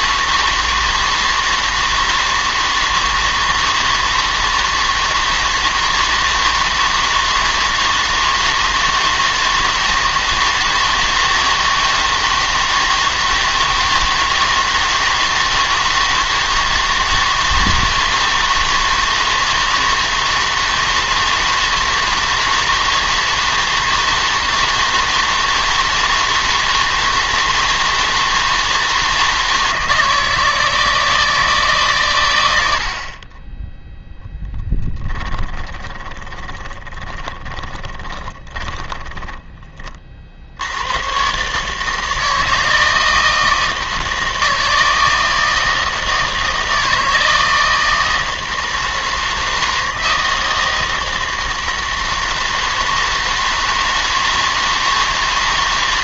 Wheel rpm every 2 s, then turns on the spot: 160, 160, 160, 160, 160, 160, 160, 160, 160, 160, 160, 160, 160, 160, 160, 160, 80, 10, 10, 20, 80, 160, 160, 160, 160, 160, 160, 160.
34-40